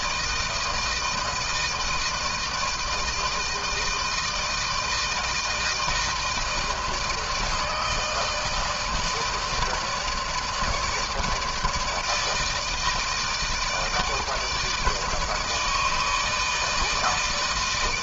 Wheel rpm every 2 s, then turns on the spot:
160, 160, 160, 160, 160, 160, 150, 160, 160.
none